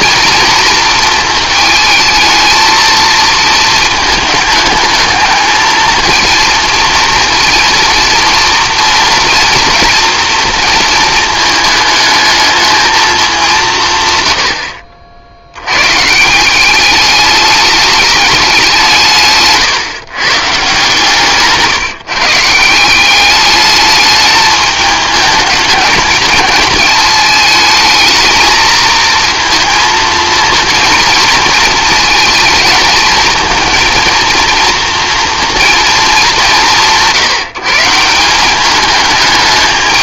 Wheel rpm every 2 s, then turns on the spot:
230, 230, 220, 230, 230, 230, 220, 80, 190, 190, 140, 170, 210, 220, 220, 230, 220, 230, 180, 200.
14-16